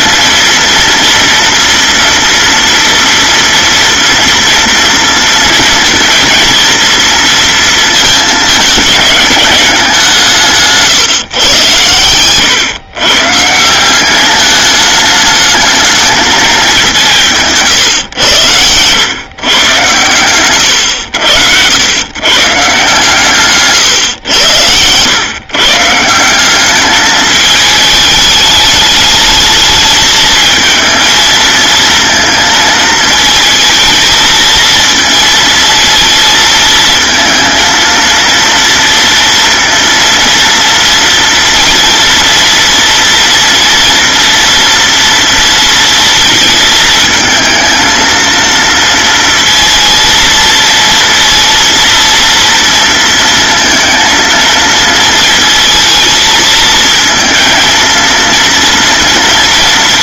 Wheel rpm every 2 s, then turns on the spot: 230, 230, 230, 230, 210, 160, 120, 210, 200, 110, 100, 150, 100, 210, 210, 220, 220, 230, 220, 230, 230, 230, 230, 220, 230, 230, 230, 230, 220, 230.
none